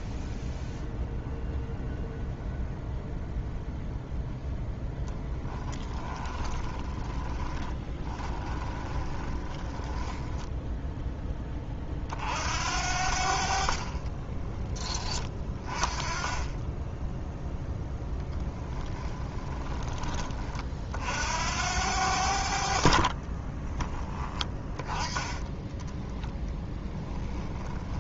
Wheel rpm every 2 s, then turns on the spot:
0, 0, 10, 20, 20, 10, 70, 20, 10, 20, 50, 50, 20, 20.
4-10 18-20 22-28